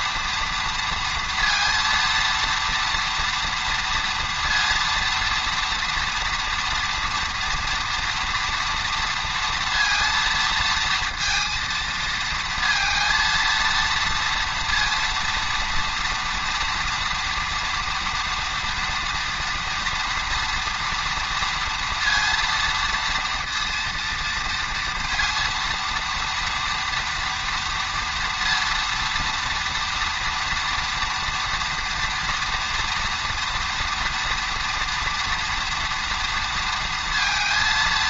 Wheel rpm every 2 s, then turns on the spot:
230, 230, 230, 230, 230, 230, 230, 240, 230, 230, 230, 230, 230, 230, 230, 230, 230, 230, 230.
none